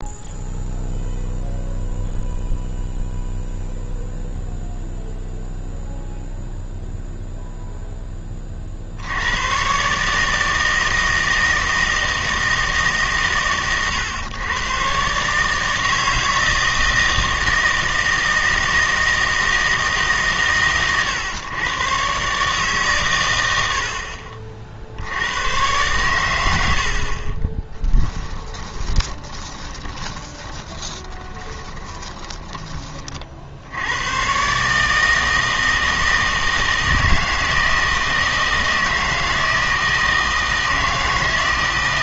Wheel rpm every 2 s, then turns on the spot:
0, 0, 0, 0, 80, 160, 130, 140, 160, 160, 120, 110, 90, 40, 20, 20, 50, 160, 160, 160, 160.
28-32